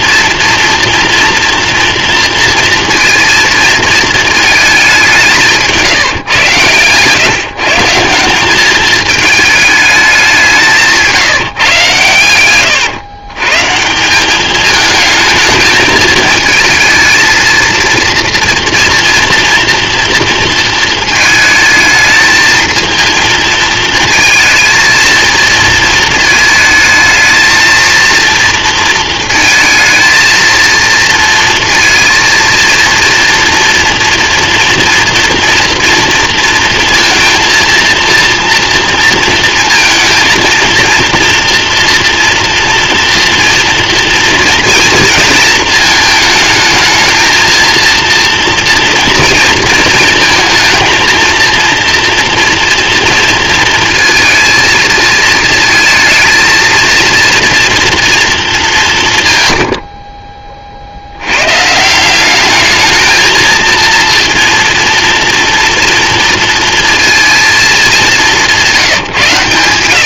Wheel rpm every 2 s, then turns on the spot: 230, 230, 210, 120, 200, 180, 110, 210, 220, 230, 230, 220, 230, 220, 230, 230, 230, 230, 230, 230, 230, 240, 230, 220, 230, 220, 240, 230, 230, 200, 30, 210, 230, 230, 180.
none